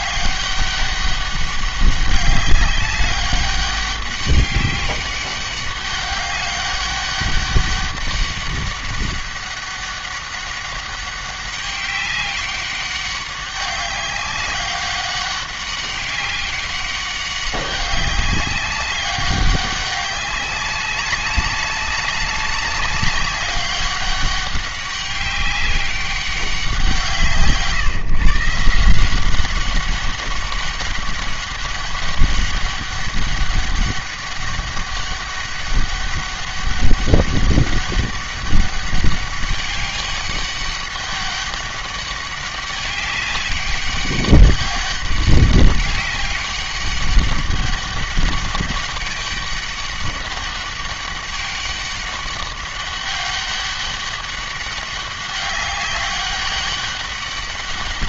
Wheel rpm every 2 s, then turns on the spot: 200, 200, 200, 200, 200, 200, 200, 190, 200, 200, 200, 190, 200, 180, 170, 200, 200, 200, 200, 200, 200, 200, 200, 200, 200, 200, 200, 200, 200.
none